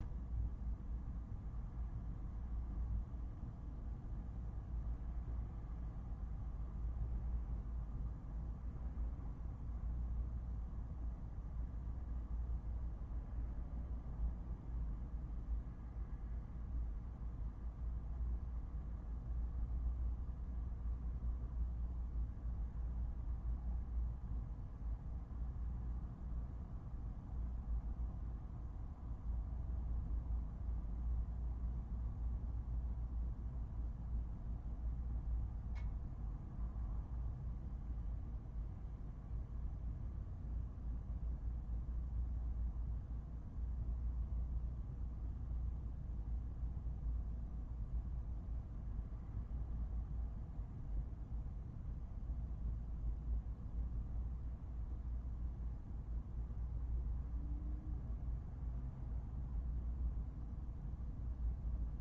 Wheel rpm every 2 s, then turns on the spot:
0, 0, 0, 0, 0, 0, 0, 0, 0, 0, 0, 0, 0, 0, 0, 0, 0, 0, 0, 0, 0, 0, 0, 0, 0, 0, 0, 0, 0, 0, 0.
none